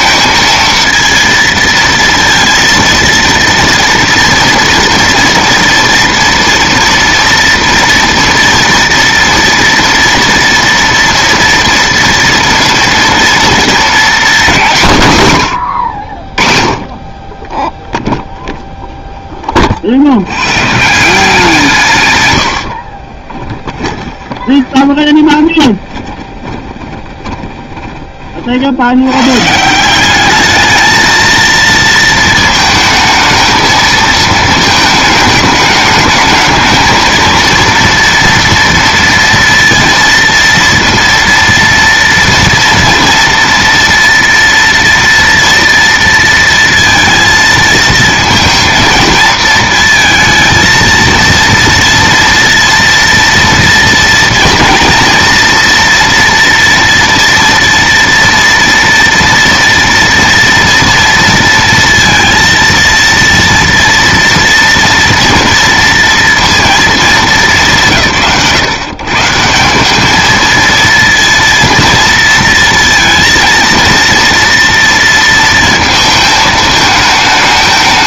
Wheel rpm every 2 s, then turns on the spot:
230, 230, 240, 230, 230, 230, 230, 110, 10, 10, 160, 30, 20, 30, 110, 220, 220, 210, 220, 230, 230, 230, 230, 230, 230, 230, 230, 230, 230, 230, 230, 230, 240, 230, 140, 230, 230, 230, 220.
22-28